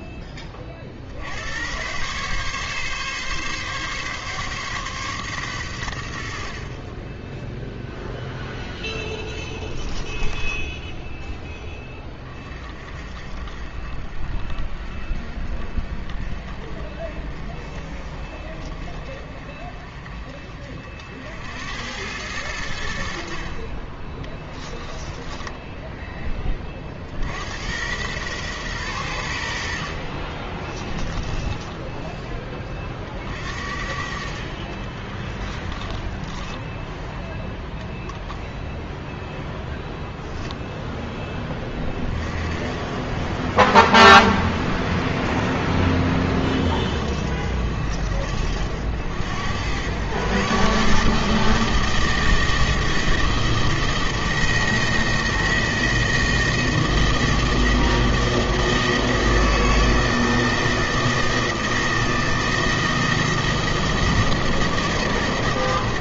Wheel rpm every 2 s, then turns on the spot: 30, 140, 140, 40, 0, 10, 30, 30, 30, 30, 40, 90, 20, 20, 110, 20, 30, 40, 10, 0, 0, 60, 60, 60, 80, 130, 160, 160, 160, 160, 160, 160, 160.
10-12 24-26 30-32 34-38